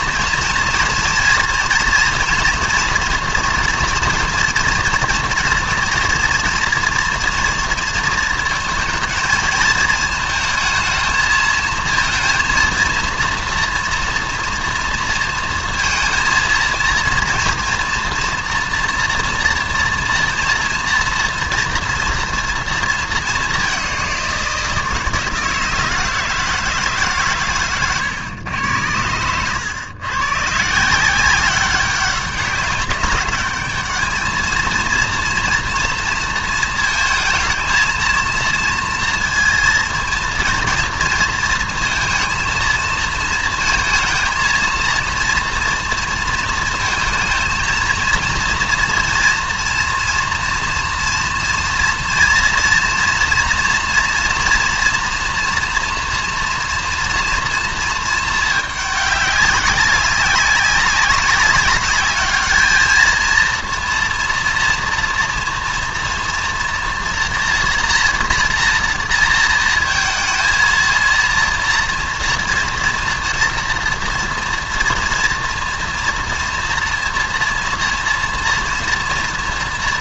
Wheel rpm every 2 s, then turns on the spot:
230, 230, 240, 230, 230, 220, 230, 230, 230, 230, 230, 230, 170, 150, 100, 150, 200, 230, 230, 230, 230, 230, 230, 230, 230, 230, 230, 230, 230, 210, 200, 220, 230, 240, 230, 220, 230, 230, 240, 230.
none